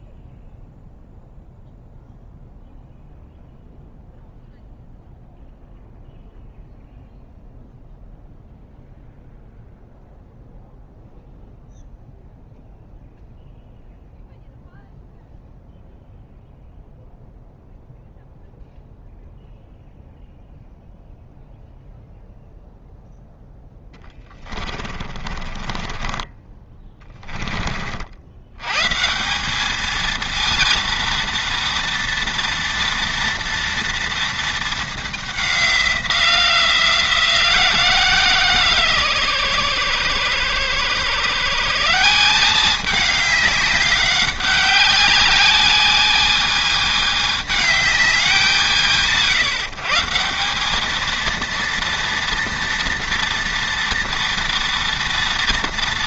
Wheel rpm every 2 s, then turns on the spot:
0, 0, 0, 0, 0, 0, 0, 0, 0, 0, 0, 0, 20, 20, 110, 230, 230, 220, 170, 150, 120, 200, 200, 210, 170, 200, 230, 230.
24-28